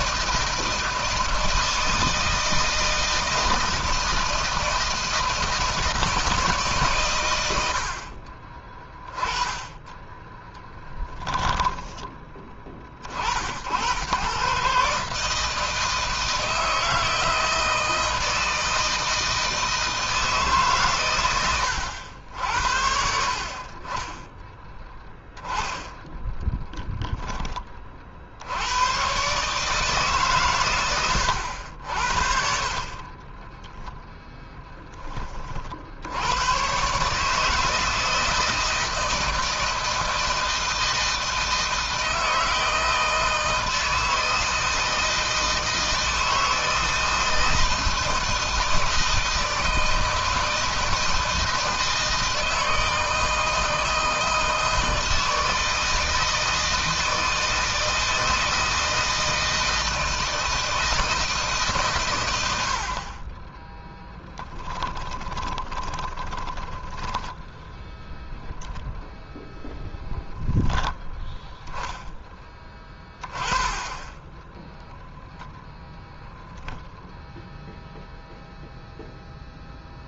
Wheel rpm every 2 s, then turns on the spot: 160, 160, 160, 140, 30, 10, 40, 140, 160, 160, 130, 70, 10, 10, 100, 120, 40, 20, 130, 160, 160, 160, 160, 160, 160, 160, 160, 160, 160, 160, 160, 60, 10, 10, 0, 10, 10, 10, 0, 0.
10-12 32-34 64-68